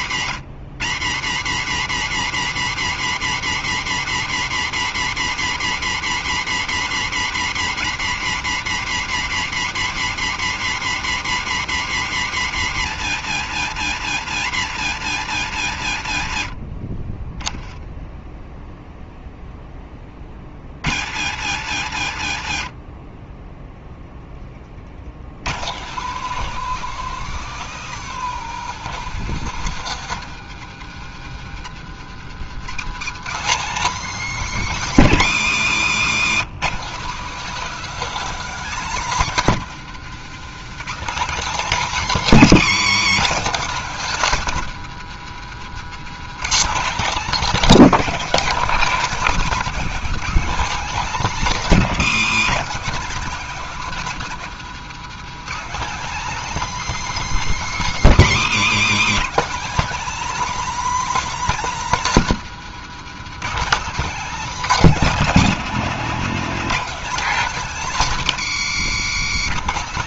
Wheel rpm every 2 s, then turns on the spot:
110, 140, 140, 140, 140, 140, 120, 110, 20, 0, 80, 20, 70, 190, 200, 150, 200, 210, 220, 230, 230, 240, 200, 260, 250, 270, 240, 210, 300, 230, 300, 220, 250, 260, 210.
none